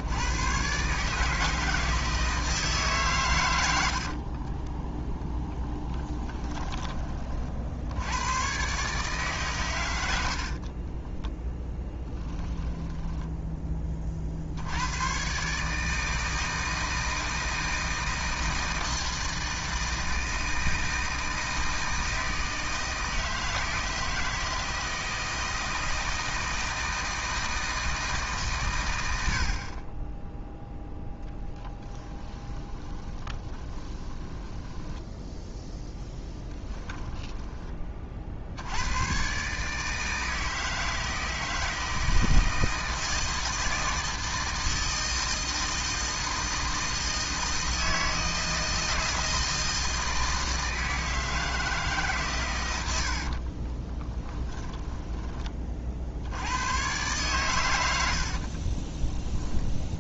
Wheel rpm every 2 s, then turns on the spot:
140, 140, 10, 20, 140, 20, 20, 100, 160, 160, 160, 160, 160, 160, 100, 0, 20, 10, 10, 100, 160, 160, 160, 160, 160, 160, 80, 10, 110, 20.
10-14 32-38 52-56 58-60